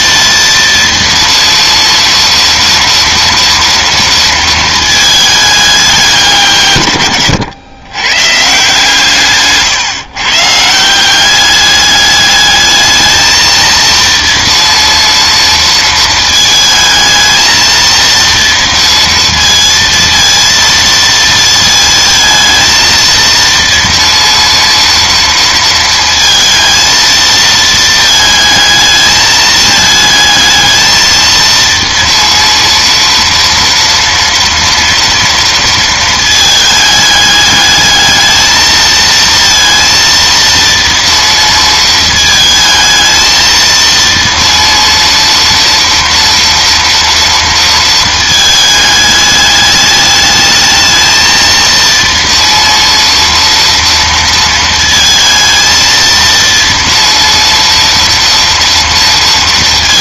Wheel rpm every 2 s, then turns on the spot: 230, 230, 220, 130, 150, 160, 220, 230, 220, 230, 230, 230, 230, 230, 220, 220, 230, 230, 210, 220, 230, 220, 230, 230, 210, 220, 230, 220, 230, 240.
none